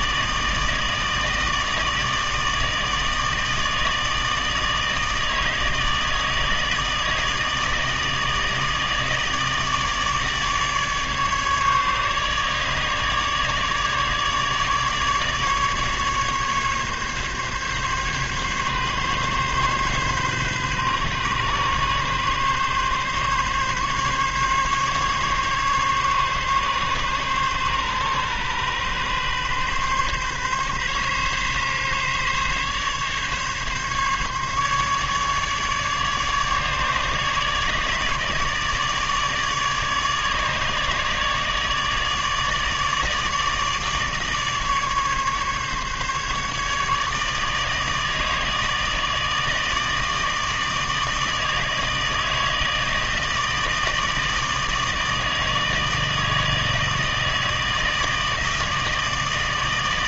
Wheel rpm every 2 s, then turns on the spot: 160, 160, 160, 160, 160, 150, 150, 150, 140, 140, 130, 140, 140, 140, 130, 140, 140, 140, 150, 150, 150, 150, 150, 150, 160, 160, 160, 160, 160, 160.
none